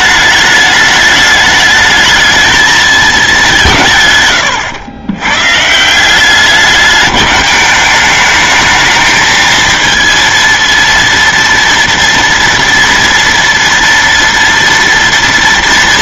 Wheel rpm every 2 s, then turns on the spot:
210, 220, 100, 200, 220, 230, 230, 230.
none